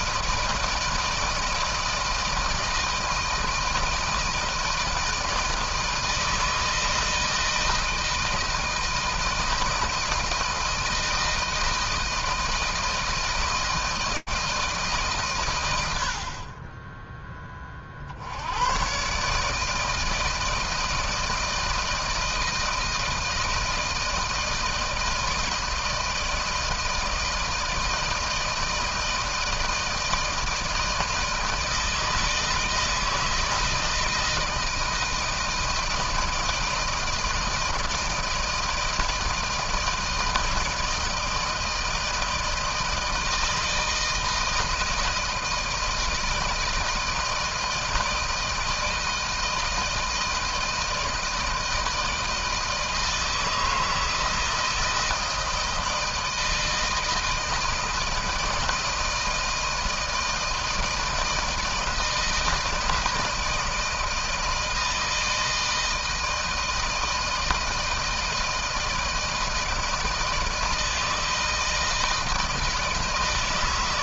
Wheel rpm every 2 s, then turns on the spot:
160, 160, 160, 160, 160, 160, 160, 150, 20, 120, 160, 160, 160, 170, 160, 160, 160, 160, 160, 160, 160, 160, 160, 160, 160, 160, 160, 160, 160, 160, 160, 160, 160, 160, 160, 160, 160.
none